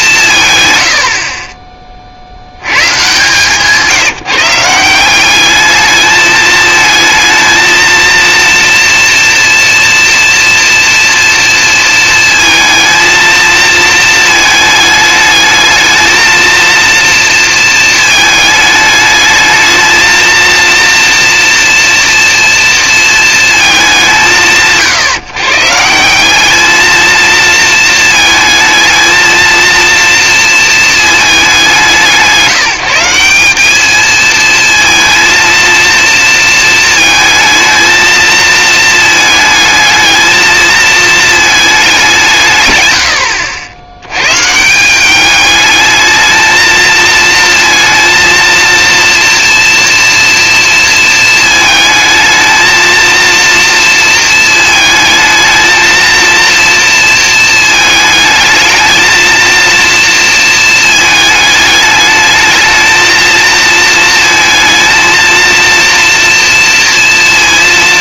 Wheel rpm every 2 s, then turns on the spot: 150, 90, 160, 220, 230, 230, 230, 220, 230, 220, 230, 230, 150, 200, 220, 230, 160, 220, 230, 230, 220, 150, 150, 220, 230, 230, 220, 220, 230, 220, 230, 220, 230, 230.
none